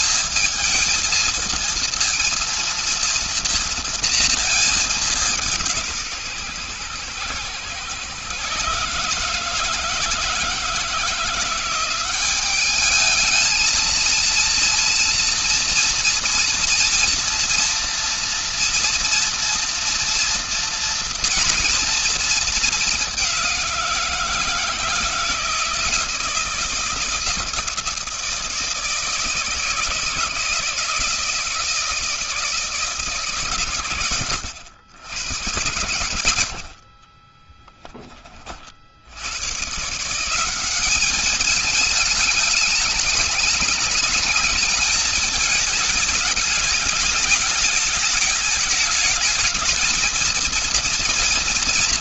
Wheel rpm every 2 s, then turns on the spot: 220, 230, 220, 140, 130, 160, 200, 230, 230, 230, 240, 220, 170, 170, 160, 170, 160, 100, 80, 40, 180, 210, 220, 210, 210, 230.
36-38